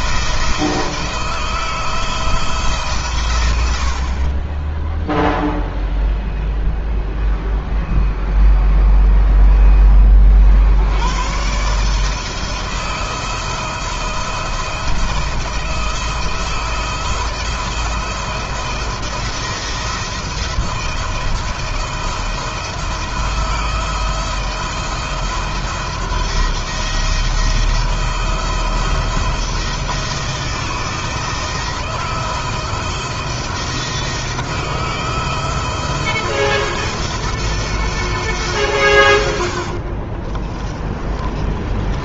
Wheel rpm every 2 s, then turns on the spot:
170, 140, 10, 0, 0, 100, 170, 170, 160, 170, 160, 170, 170, 170, 170, 160, 170, 170, 170, 110, 40.
40-42